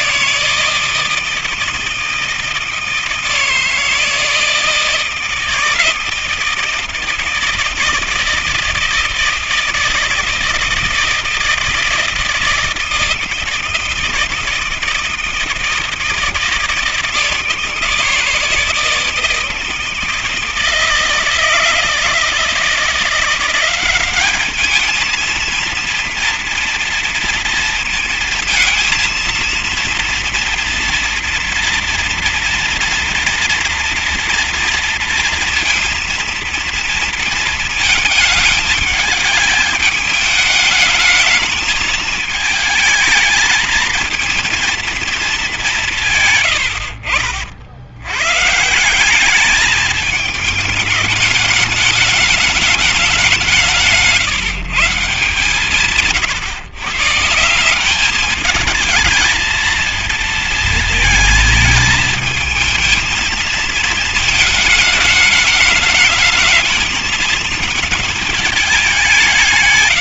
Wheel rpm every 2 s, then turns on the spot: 160, 160, 160, 160, 160, 160, 160, 160, 160, 160, 160, 160, 210, 230, 220, 230, 240, 230, 220, 210, 220, 220, 230, 110, 150, 210, 210, 170, 140, 210, 230, 220, 220, 220, 210.
46-48